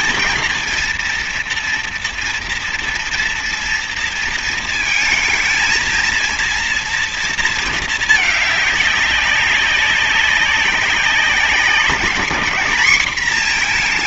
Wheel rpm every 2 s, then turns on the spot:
230, 240, 220, 230, 200, 190, 220.
none